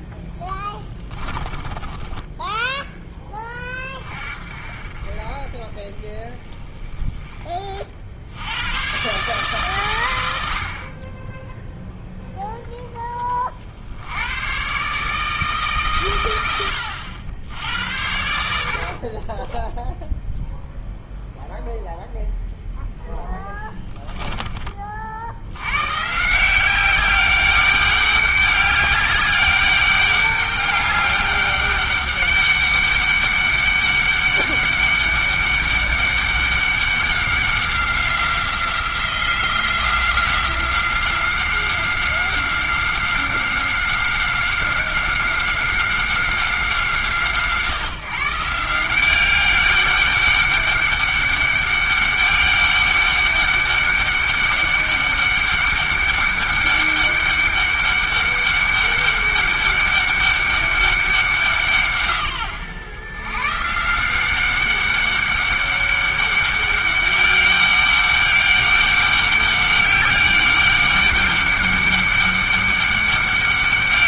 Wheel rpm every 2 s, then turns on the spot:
20, 10, 40, 20, 110, 40, 20, 140, 80, 50, 0, 0, 40, 190, 200, 200, 200, 200, 190, 180, 180, 190, 190, 170, 180, 200, 200, 200, 200, 200, 200, 120, 190, 200, 200, 200, 200.
0-2 18-20